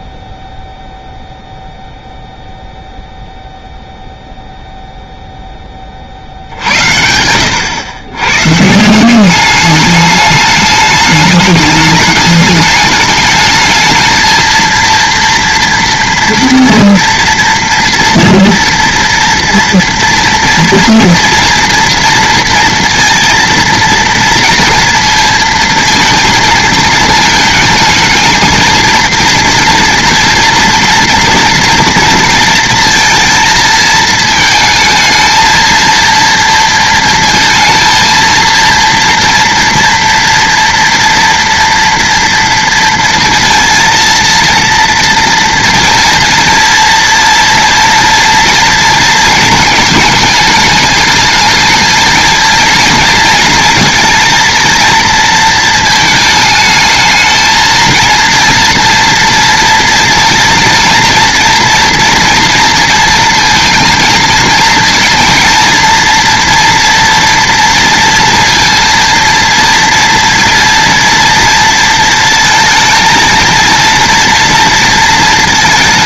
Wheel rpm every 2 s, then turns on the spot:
0, 0, 0, 90, 180, 210, 210, 230, 230, 240, 230, 230, 230, 220, 230, 230, 230, 220, 230, 230, 240, 230, 230, 230, 230, 210, 230, 230, 220, 230, 240, 230, 230, 230, 230, 230, 230, 230.
none